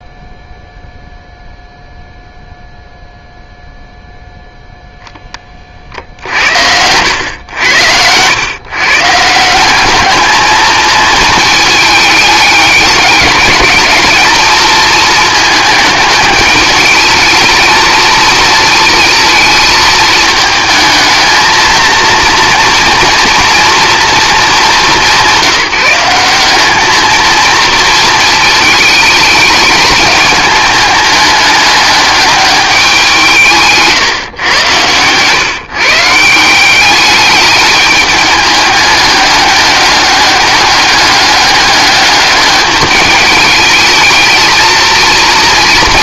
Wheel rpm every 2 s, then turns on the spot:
0, 0, 0, 90, 140, 220, 210, 220, 210, 220, 220, 230, 210, 210, 220, 210, 190, 110, 190, 210, 200, 210, 230.
none